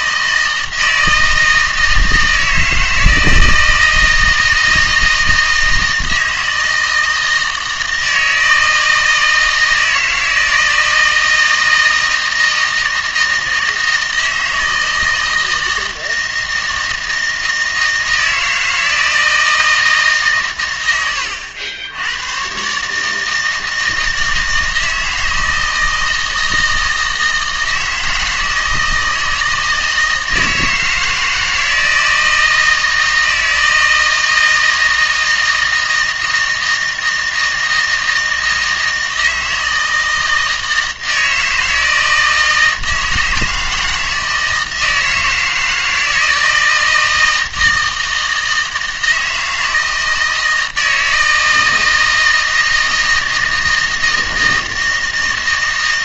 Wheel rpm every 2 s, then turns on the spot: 160, 160, 160, 160, 160, 160, 160, 160, 160, 160, 120, 140, 160, 160, 160, 160, 160, 160, 160, 160, 160, 160, 160, 160, 160, 160, 160, 160.
none